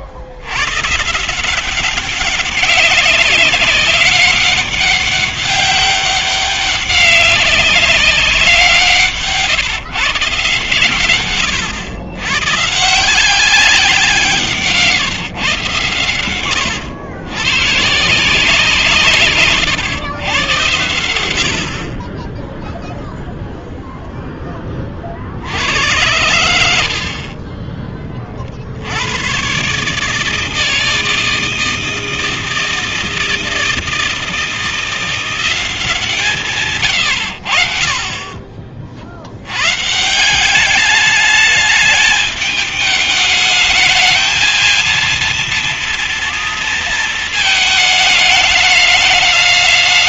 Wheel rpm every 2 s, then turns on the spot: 100, 200, 200, 200, 170, 140, 140, 160, 100, 160, 110, 0, 20, 60, 60, 160, 160, 170, 130, 40, 200, 210, 230, 230, 210.
36-38